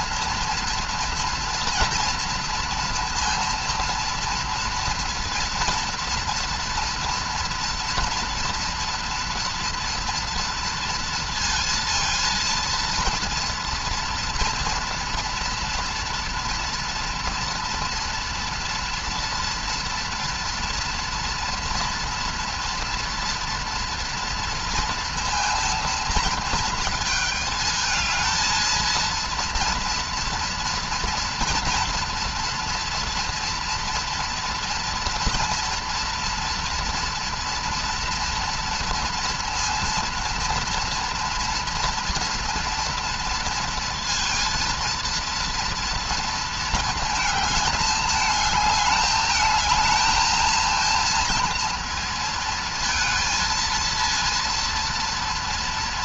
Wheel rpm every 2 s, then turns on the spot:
230, 230, 230, 230, 230, 230, 230, 230, 230, 240, 240, 240, 230, 230, 230, 230, 230, 230, 230, 230, 240, 230, 230, 230, 220, 230, 230, 230.
none